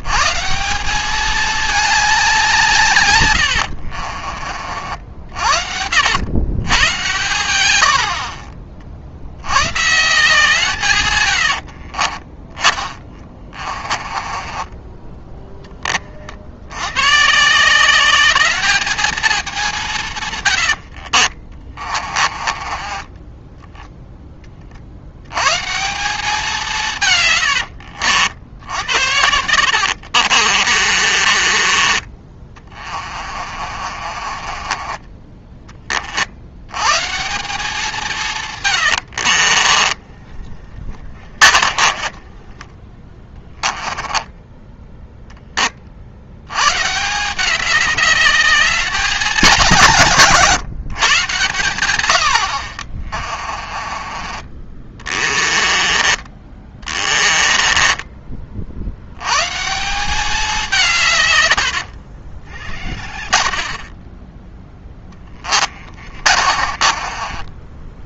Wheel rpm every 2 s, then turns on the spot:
190, 130, 60, 110, 60, 140, 20, 20, 110, 220, 60, 20, 70, 150, 90, 40, 30, 20, 140, 80, 40, 20, 10, 140, 210, 140, 40, 20, 20, 80, 150, 50, 10, 30.
12-16 20-24 30-36 38-42 52-58 64-68